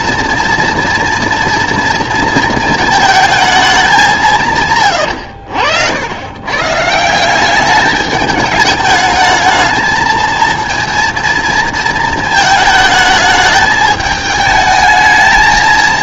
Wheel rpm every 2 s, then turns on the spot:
230, 220, 140, 150, 210, 230, 220, 220.
none